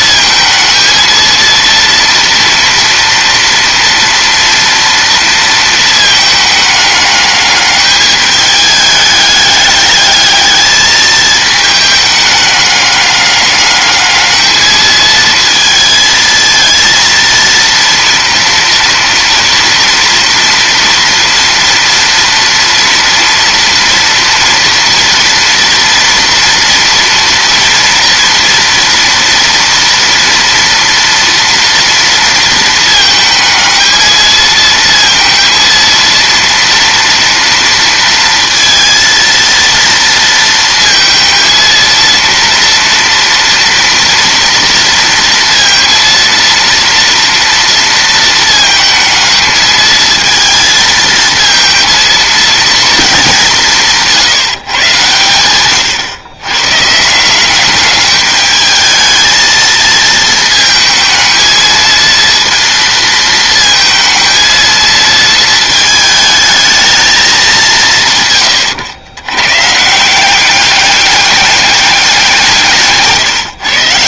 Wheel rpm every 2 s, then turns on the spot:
220, 230, 240, 210, 210, 210, 210, 220, 230, 230, 230, 230, 230, 230, 240, 230, 220, 220, 230, 230, 230, 230, 230, 230, 220, 220, 230, 140, 130, 210, 220, 230, 230, 220, 110, 200, 170.
none